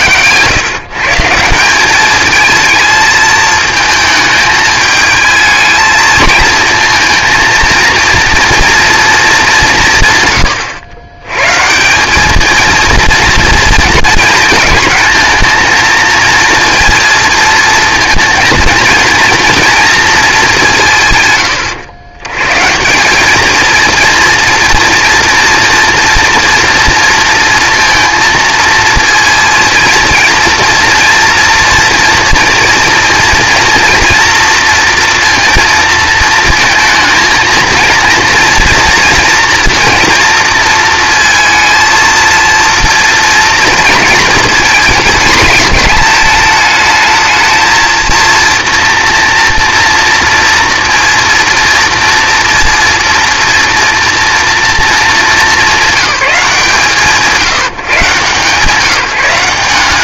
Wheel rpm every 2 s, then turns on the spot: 140, 220, 220, 230, 230, 110, 230, 230, 230, 230, 190, 160, 240, 230, 230, 230, 230, 230, 230, 230, 230, 230, 230, 220, 230, 230, 230, 230, 170, 150.
none